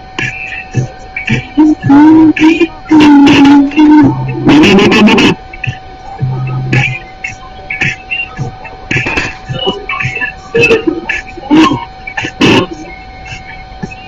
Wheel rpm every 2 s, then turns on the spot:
0, 0, 0, 0, 0, 0, 0.
none